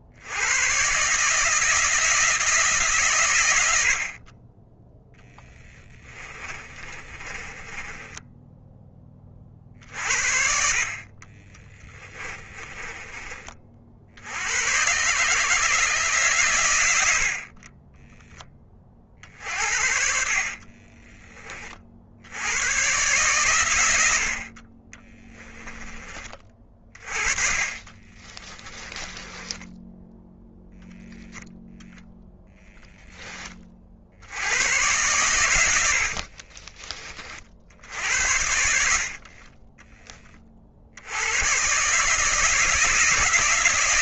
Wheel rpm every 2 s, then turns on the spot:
120, 150, 10, 30, 20, 50, 20, 120, 100, 30, 30, 120, 30, 30, 20, 0, 10, 110, 30, 60, 70, 170.
6-8 12-14 20-22 26-30 38-40